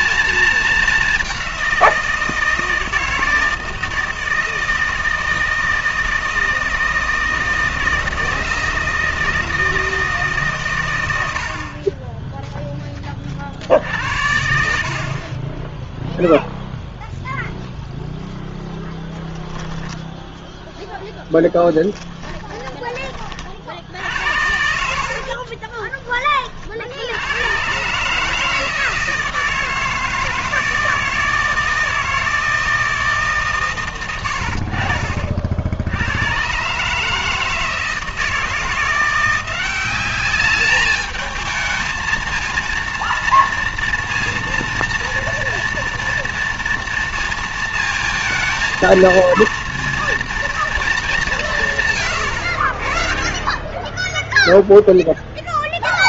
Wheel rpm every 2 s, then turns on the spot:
210, 160, 160, 160, 160, 130, 10, 60, 0, 10, 0, 20, 70, 60, 160, 160, 170, 60, 140, 170, 210, 230, 230, 230, 230, 220, 40, 0.
24-26